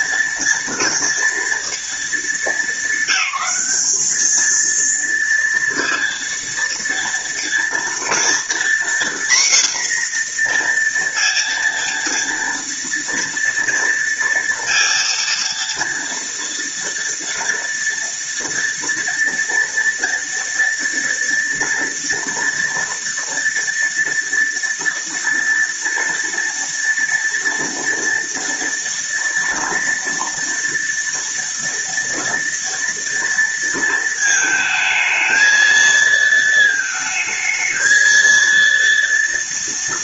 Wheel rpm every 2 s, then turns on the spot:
230, 220, 230, 230, 240, 240, 230, 230, 230, 230, 230, 230, 230, 230, 230, 230, 230, 220, 220, 230.
none